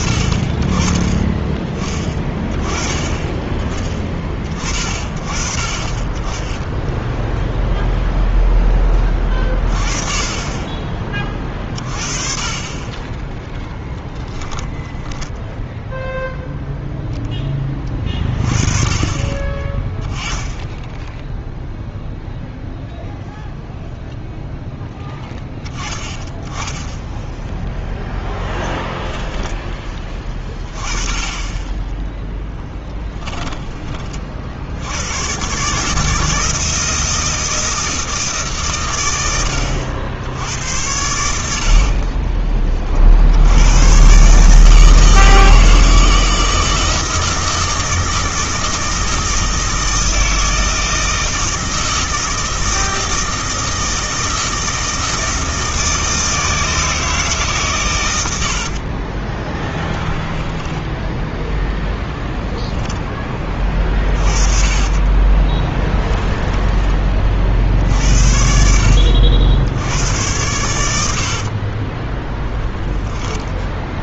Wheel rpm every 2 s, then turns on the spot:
20, 20, 40, 0, 10, 30, 20, 10, 0, 30, 10, 0, 0, 10, 0, 20, 20, 70, 160, 130, 80, 30, 150, 160, 160, 160, 160, 160, 160, 60, 10, 0, 30, 10, 60, 100, 10.
32-34 58-62 64-66 72-74